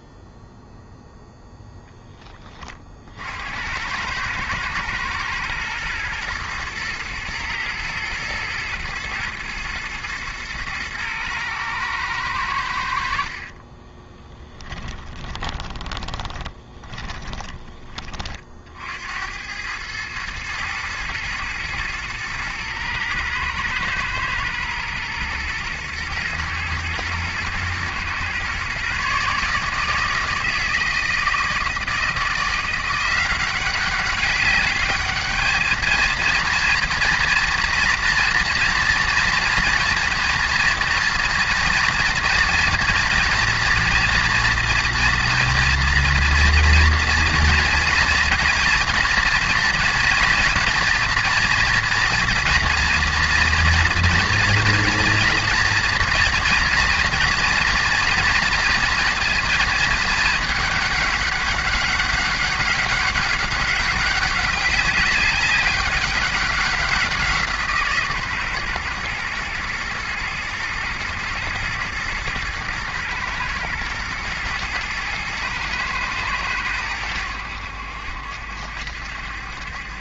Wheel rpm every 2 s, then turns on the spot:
0, 40, 110, 120, 120, 110, 80, 20, 20, 60, 110, 110, 120, 110, 130, 160, 170, 200, 230, 230, 230, 240, 230, 230, 230, 230, 240, 240, 240, 230, 210, 200, 200, 190, 130, 110, 110, 120, 100, 70.
14-18